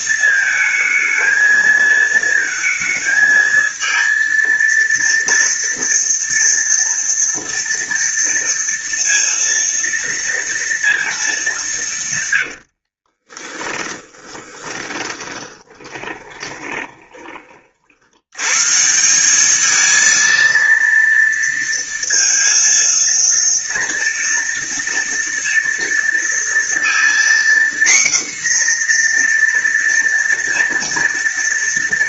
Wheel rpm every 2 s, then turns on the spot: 220, 230, 230, 230, 230, 230, 60, 20, 20, 150, 230, 230, 230, 240, 250, 230.
12-18